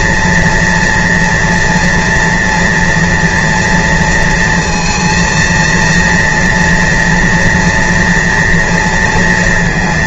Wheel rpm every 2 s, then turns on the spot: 230, 230, 230, 240, 230.
none